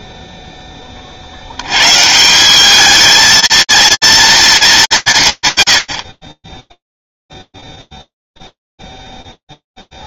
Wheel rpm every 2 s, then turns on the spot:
10, 200, 200, 10, 0.
none